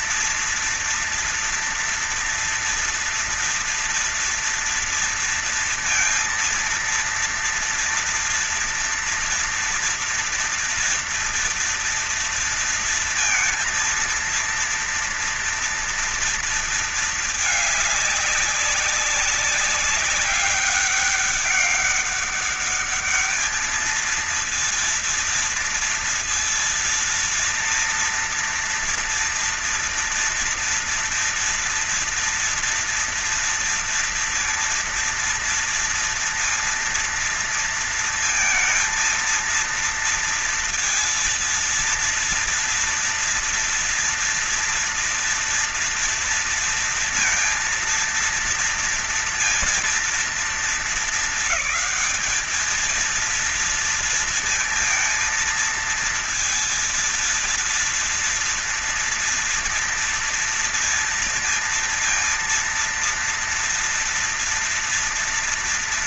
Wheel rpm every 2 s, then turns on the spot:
230, 230, 230, 230, 230, 240, 230, 230, 230, 200, 200, 200, 230, 230, 230, 230, 230, 230, 230, 230, 230, 230, 230, 230, 230, 230, 210, 230, 230, 230, 230, 230, 230.
none